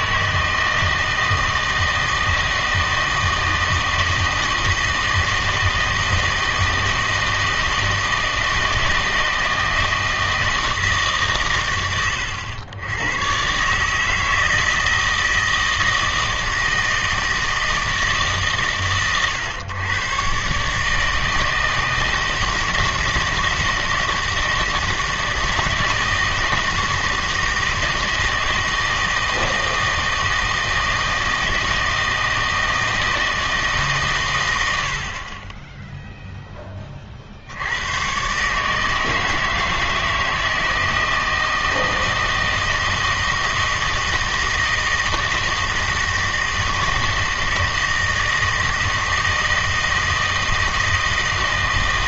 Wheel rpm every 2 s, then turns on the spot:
160, 160, 160, 160, 160, 160, 90, 160, 160, 130, 140, 160, 160, 160, 160, 160, 160, 90, 10, 150, 160, 160, 160, 160, 160, 160.
none